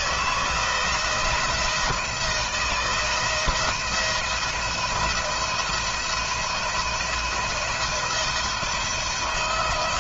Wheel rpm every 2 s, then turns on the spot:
160, 160, 160, 170, 170.
none